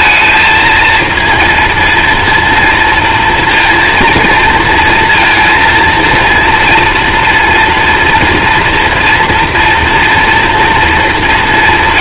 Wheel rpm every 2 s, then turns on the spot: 220, 230, 230, 240, 230, 230.
none